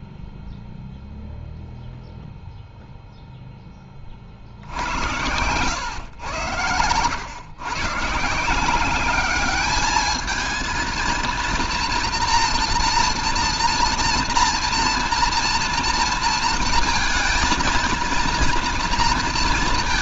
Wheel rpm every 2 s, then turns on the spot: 0, 0, 70, 100, 180, 230, 230, 230, 230, 230.
none